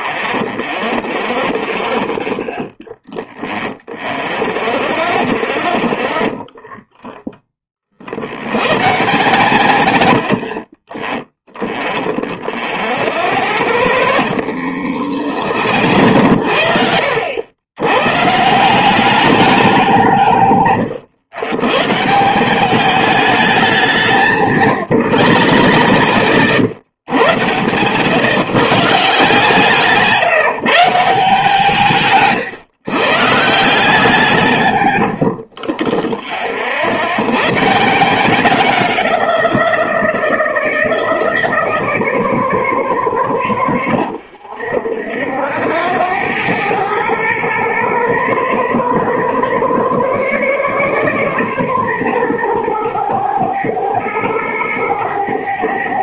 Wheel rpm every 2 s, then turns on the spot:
10, 10, 10, 10, 50, 10, 0, 30, 70, 160, 130, 190, 140, 100, 140, 160, 130, 120, 20, 10, 0, 0, 0, 0, 0, 0, 0, 0.
0-4 6-8 14-16 24-26